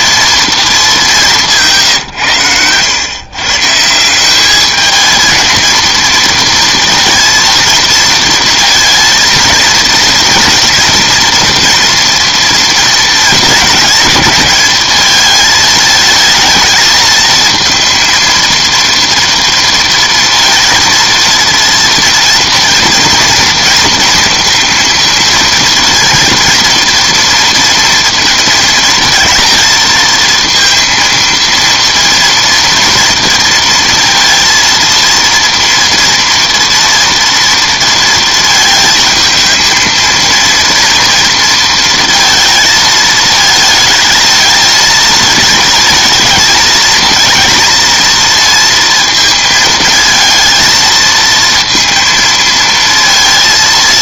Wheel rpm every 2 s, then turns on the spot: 220, 100, 210, 230, 230, 230, 230, 210, 220, 230, 230, 230, 230, 230, 230, 230, 230, 230, 230, 220, 230, 220, 220, 220, 230, 230, 230.
none